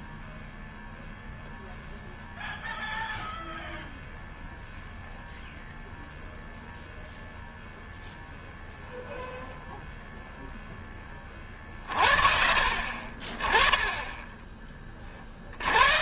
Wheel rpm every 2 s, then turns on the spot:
0, 0, 0, 0, 0, 10, 40, 20.
none